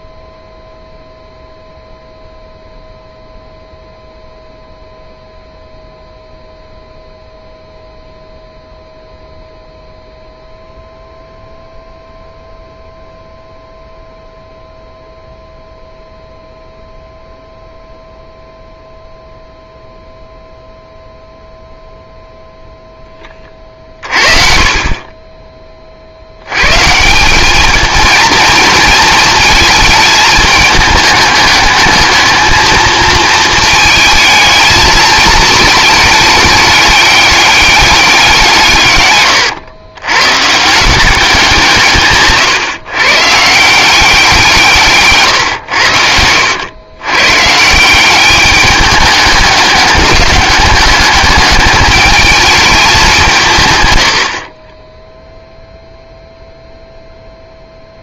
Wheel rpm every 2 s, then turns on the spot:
0, 0, 0, 0, 0, 0, 0, 0, 0, 0, 0, 0, 40, 140, 220, 210, 220, 220, 200, 140, 170, 130, 150, 100, 210, 210, 210, 30, 0.
none